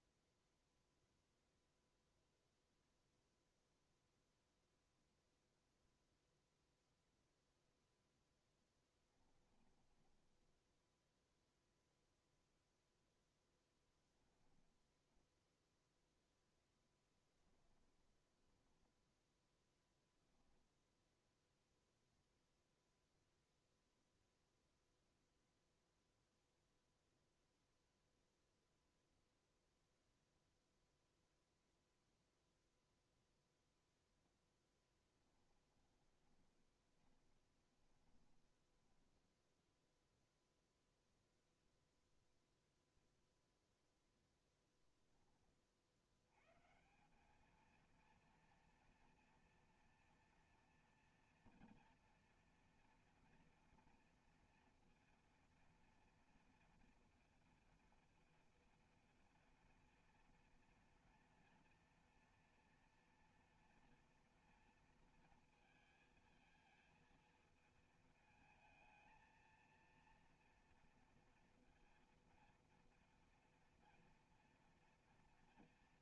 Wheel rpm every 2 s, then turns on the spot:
0, 0, 0, 0, 10, 10, 0, 20, 10, 10, 0, 0, 0, 0, 0, 0, 0, 10, 20, 20, 0, 0, 10, 160, 230, 230, 240, 230, 230, 230, 230, 230, 230, 230, 220, 230, 230, 230.
8-12 14-16 18-20 34-40